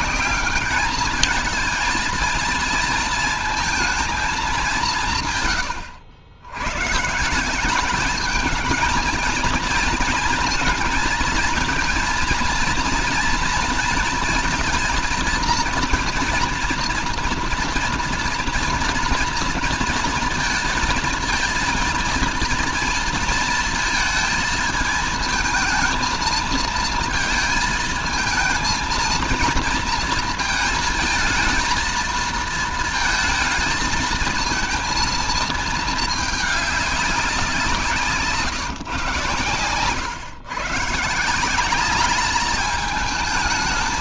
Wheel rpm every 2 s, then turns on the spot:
210, 230, 180, 120, 220, 230, 230, 230, 230, 230, 230, 230, 220, 220, 230, 230, 220, 230, 200, 130, 150, 210.
none